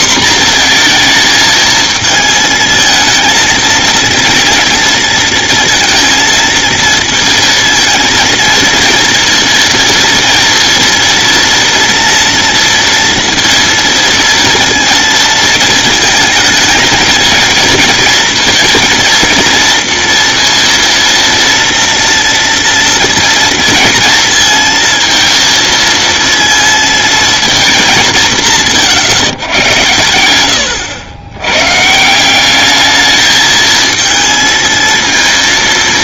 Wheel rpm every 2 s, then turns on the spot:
240, 220, 230, 230, 230, 230, 230, 230, 220, 230, 230, 230, 230, 230, 150, 90, 200, 230.
none